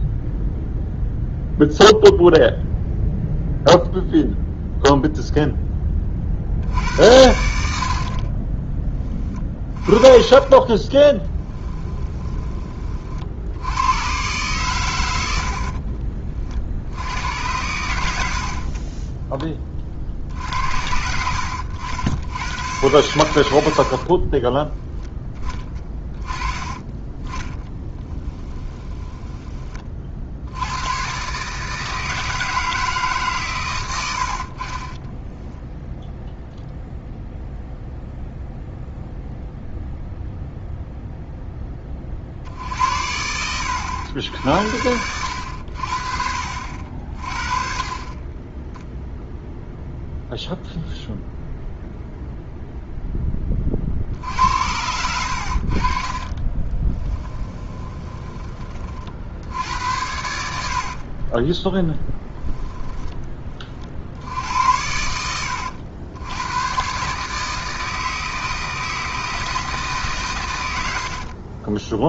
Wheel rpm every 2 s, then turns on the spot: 0, 0, 0, 50, 20, 20, 20, 110, 50, 50, 60, 100, 10, 10, 10, 100, 160, 50, 0, 0, 0, 60, 70, 60, 10, 0, 0, 70, 30, 20, 70, 10, 80, 110, 160, 100.
18-20 24-26 28-30 54-58 62-64